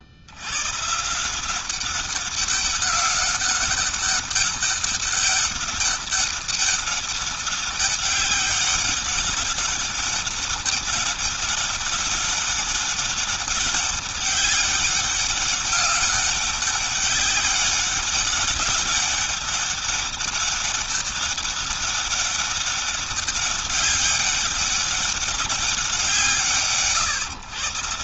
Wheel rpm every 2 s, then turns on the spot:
120, 200, 200, 200, 190, 200, 200, 200, 190, 200, 200, 200, 200, 150.
none